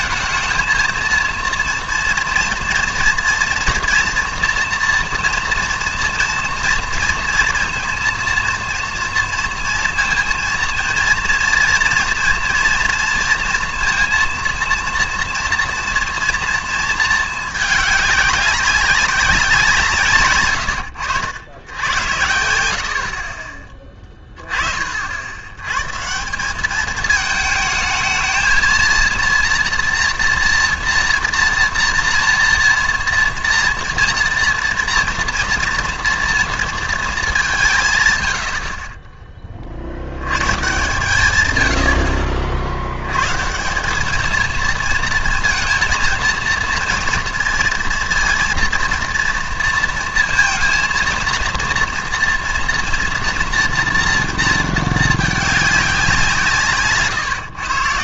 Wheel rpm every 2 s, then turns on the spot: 230, 230, 240, 230, 230, 230, 240, 230, 230, 190, 110, 80, 40, 190, 230, 240, 230, 230, 230, 50, 130, 50, 230, 230, 230, 230, 240, 230, 160.
none